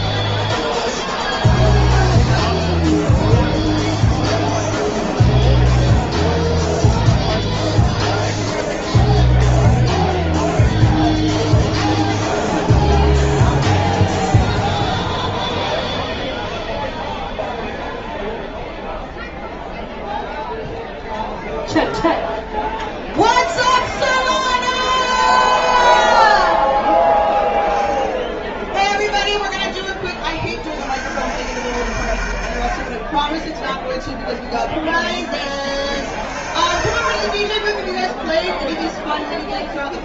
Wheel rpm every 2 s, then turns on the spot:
0, 0, 0, 0, 0, 0, 0, 0, 0, 0, 0, 0, 10, 10, 10, 50, 50, 10, 80, 0.
28-30